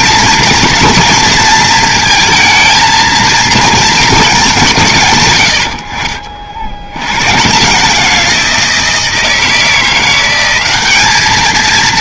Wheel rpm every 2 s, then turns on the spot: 230, 220, 150, 90, 170, 200.
none